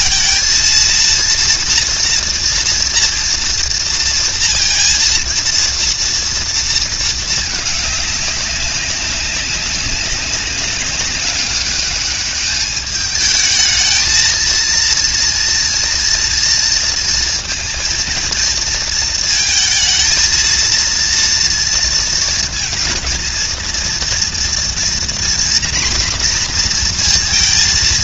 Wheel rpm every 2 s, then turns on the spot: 230, 230, 230, 220, 200, 200, 210, 230, 230, 230, 230, 230, 240, 240.
none